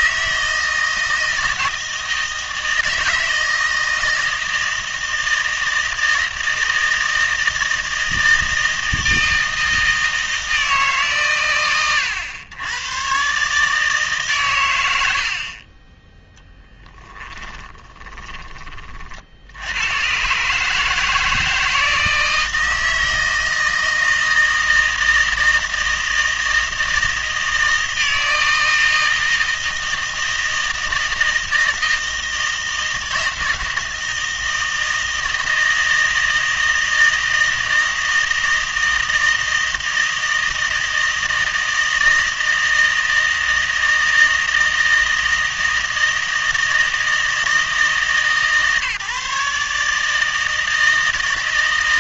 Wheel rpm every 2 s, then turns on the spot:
160, 160, 160, 160, 160, 150, 110, 100, 10, 40, 150, 160, 160, 160, 160, 160, 160, 160, 160, 160, 160, 160, 160, 160, 150, 160.
none